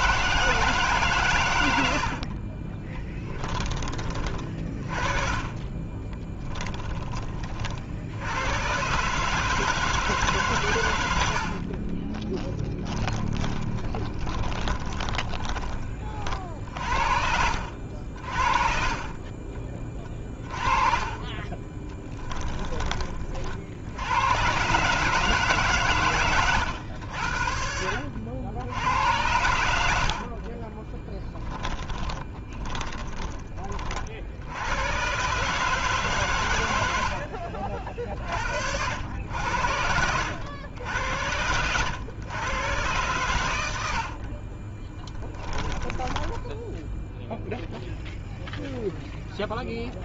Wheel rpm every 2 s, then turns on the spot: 150, 20, 30, 10, 140, 90, 30, 20, 60, 40, 30, 20, 140, 90, 90, 20, 20, 110, 80, 80, 90, 120, 20, 0, 0.
2-8 12-16 18-22 30-32 36-38 44-46